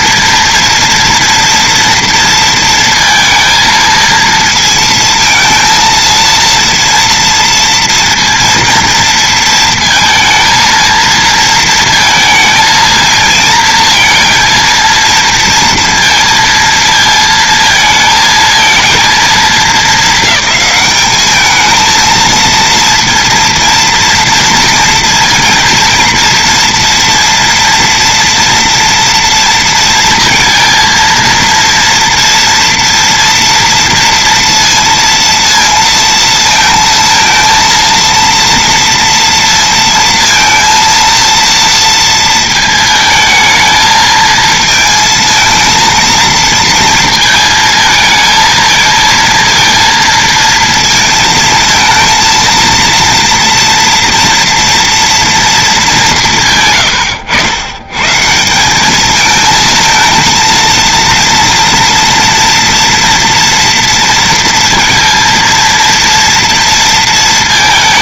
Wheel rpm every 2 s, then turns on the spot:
230, 230, 230, 230, 230, 230, 230, 230, 230, 230, 210, 230, 230, 230, 230, 230, 230, 230, 230, 230, 230, 220, 220, 230, 230, 230, 230, 230, 120, 190, 230, 230, 230, 230.
none